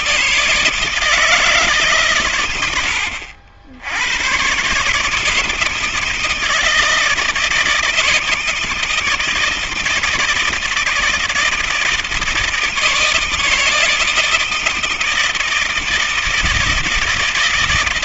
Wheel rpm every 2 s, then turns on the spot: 160, 120, 120, 160, 160, 160, 160, 160, 160.
none